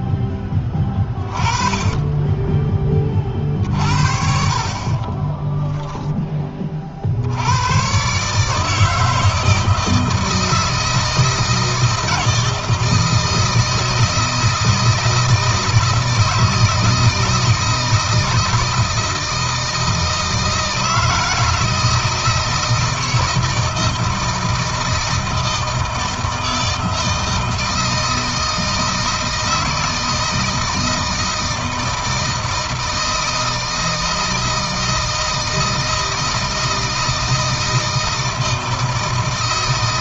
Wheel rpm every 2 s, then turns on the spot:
10, 20, 20, 40, 150, 160, 160, 160, 160, 160, 160, 160, 160, 160, 160, 160, 160, 160, 160, 160.
4-6